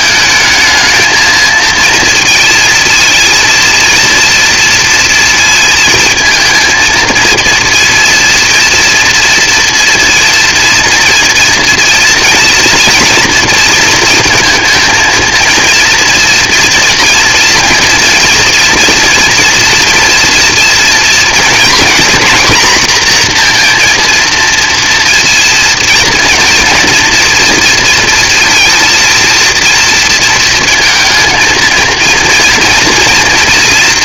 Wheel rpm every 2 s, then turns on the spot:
220, 230, 230, 220, 230, 240, 230, 230, 230, 240, 240, 240, 230, 230, 230, 220, 230.
none